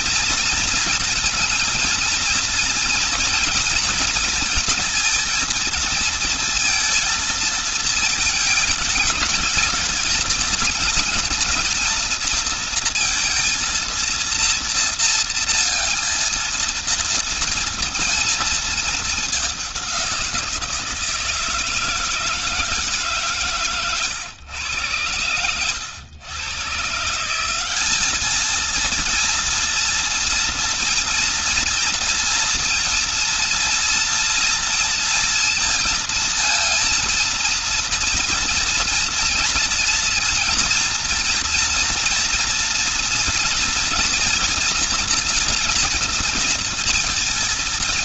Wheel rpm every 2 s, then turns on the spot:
230, 230, 230, 220, 210, 220, 230, 230, 230, 220, 170, 160, 110, 120, 220, 230, 230, 230, 230, 240, 230, 230, 230, 230.
none